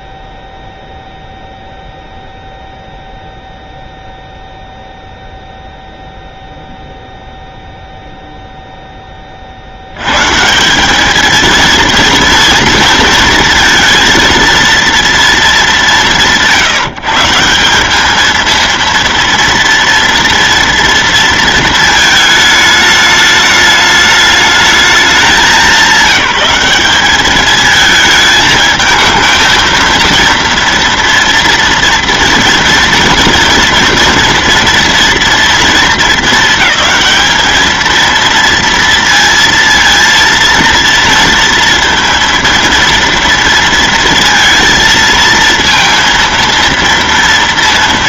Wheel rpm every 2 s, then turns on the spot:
0, 0, 0, 0, 0, 180, 230, 230, 160, 230, 230, 210, 210, 200, 220, 230, 230, 230, 220, 230, 230, 230, 230, 230.
none